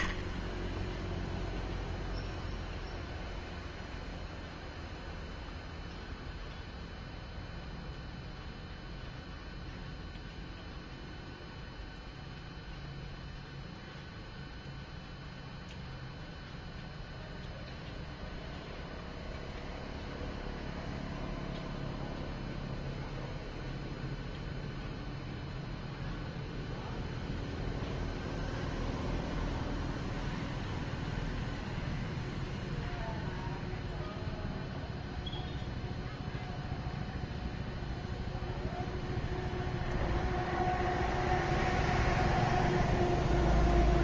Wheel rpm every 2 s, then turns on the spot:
0, 0, 0, 0, 0, 0, 0, 0, 0, 0, 0, 0, 0, 0, 0, 0, 0, 0, 0, 0, 0, 0.
none